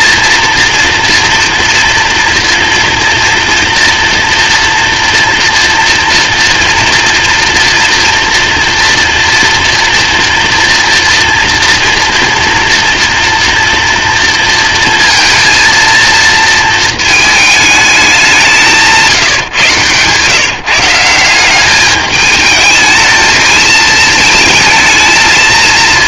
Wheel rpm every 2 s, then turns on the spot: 240, 230, 230, 230, 230, 240, 230, 230, 220, 170, 160, 220, 220.
none